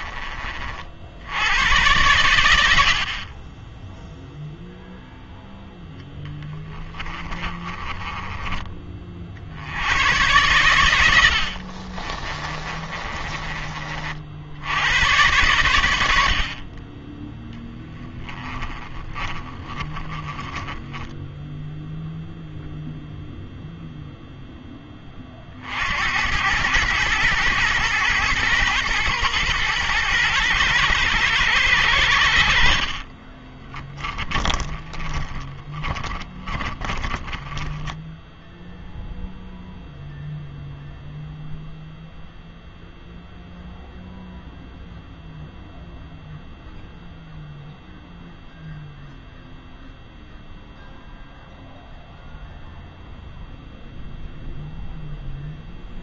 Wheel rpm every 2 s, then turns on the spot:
40, 70, 0, 30, 20, 100, 30, 90, 40, 20, 10, 0, 10, 100, 120, 120, 50, 10, 20, 0, 0, 0, 0, 0, 0, 0, 0, 0.
6-8 12-14 18-22 34-38